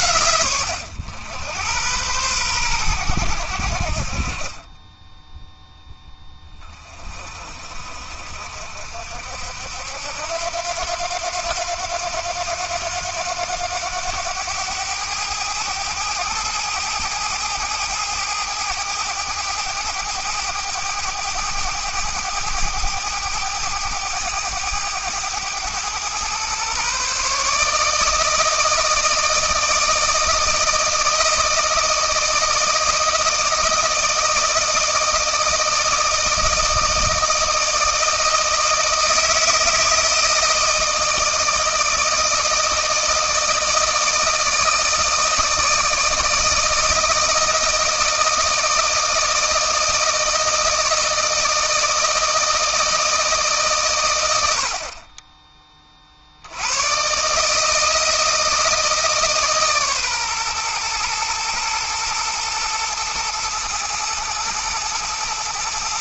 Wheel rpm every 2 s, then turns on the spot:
100, 100, 10, 30, 60, 90, 90, 100, 110, 110, 110, 110, 110, 140, 160, 160, 160, 160, 160, 160, 160, 160, 160, 170, 160, 160, 160, 30, 130, 160, 120, 120, 110.
4-6